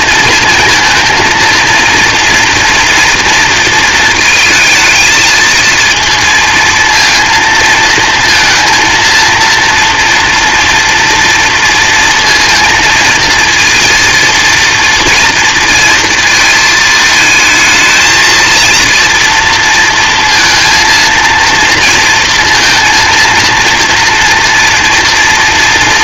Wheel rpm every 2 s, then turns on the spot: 220, 230, 220, 230, 230, 240, 230, 230, 220, 230, 230, 230, 230.
none